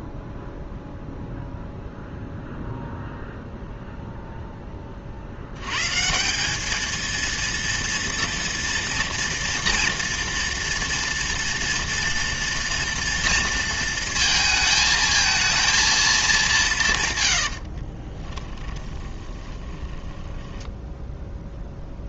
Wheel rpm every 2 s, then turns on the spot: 0, 0, 40, 220, 230, 230, 230, 220, 140, 20, 10.
18-22